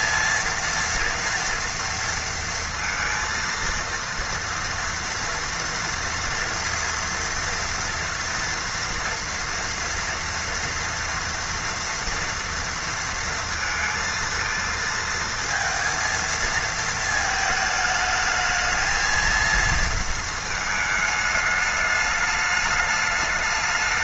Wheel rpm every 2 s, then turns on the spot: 230, 230, 230, 230, 230, 230, 230, 230, 220, 220, 220, 210.
none